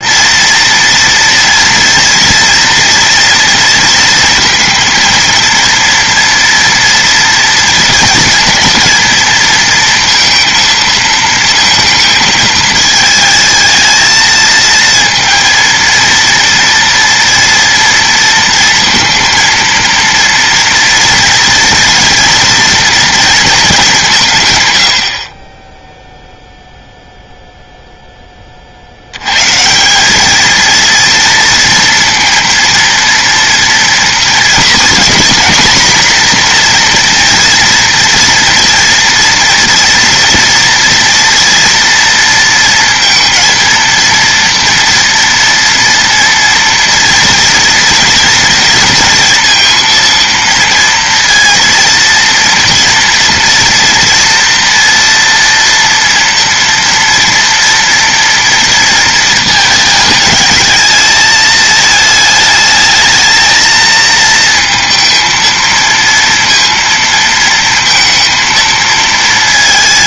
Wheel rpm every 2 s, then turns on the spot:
230, 230, 230, 230, 230, 220, 220, 220, 230, 230, 240, 230, 90, 0, 50, 230, 230, 240, 240, 230, 230, 230, 230, 230, 230, 230, 230, 230, 230, 230, 210, 220, 220, 230, 230.
none